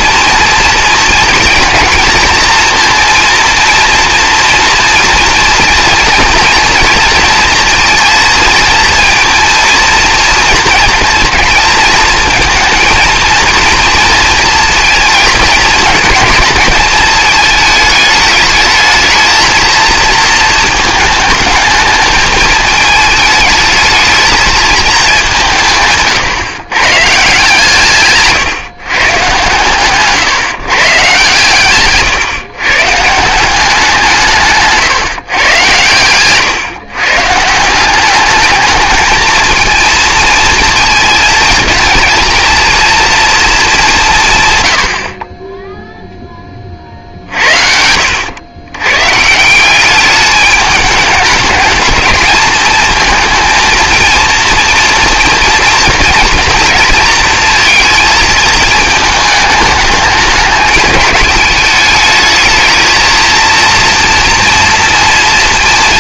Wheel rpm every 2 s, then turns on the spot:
230, 230, 230, 230, 230, 230, 230, 230, 220, 220, 220, 220, 220, 130, 140, 150, 140, 140, 140, 210, 220, 220, 100, 40, 110, 210, 220, 240, 230, 220, 210, 220, 230.
none